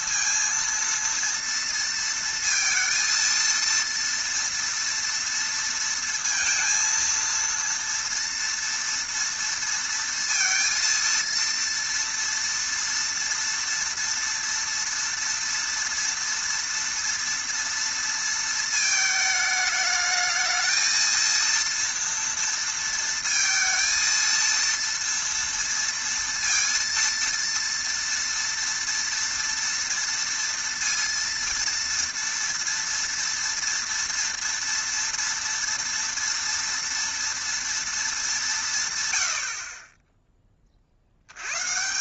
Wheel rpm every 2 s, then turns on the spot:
230, 230, 230, 230, 230, 230, 230, 230, 230, 220, 220, 230, 230, 230, 230, 230, 230, 230, 230, 150, 40.
none